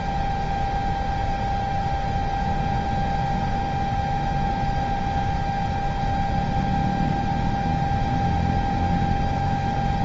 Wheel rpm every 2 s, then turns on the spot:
0, 0, 0, 0, 0.
none